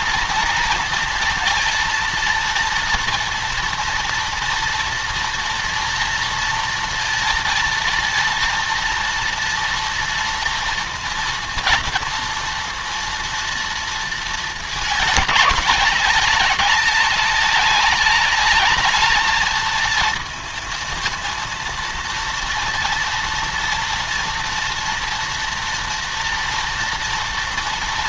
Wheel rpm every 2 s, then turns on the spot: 230, 230, 230, 230, 230, 230, 230, 220, 200, 200, 220, 230, 230, 230.
none